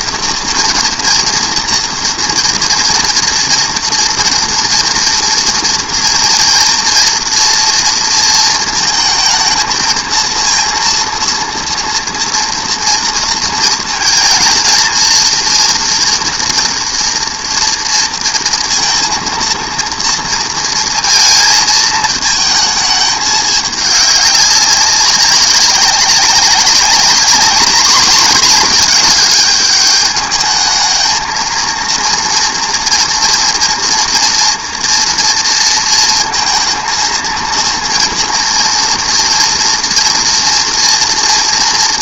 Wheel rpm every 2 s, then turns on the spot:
240, 230, 240, 230, 220, 230, 230, 230, 230, 230, 230, 220, 200, 190, 210, 210, 240, 230, 230, 230, 240.
none